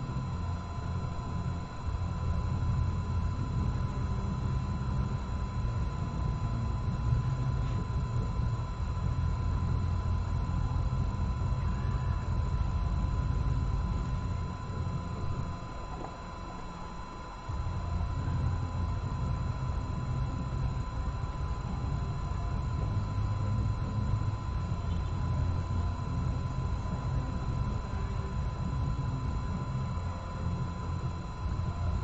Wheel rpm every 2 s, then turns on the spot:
0, 0, 0, 0, 0, 0, 0, 0, 0, 0, 0, 0, 0, 0, 0, 0.
none